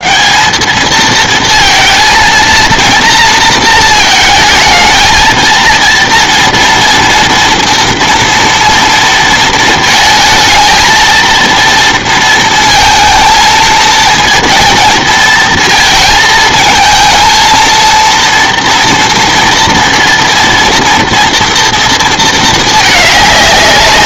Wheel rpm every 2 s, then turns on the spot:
220, 230, 220, 230, 230, 220, 220, 220, 220, 230, 230, 210.
none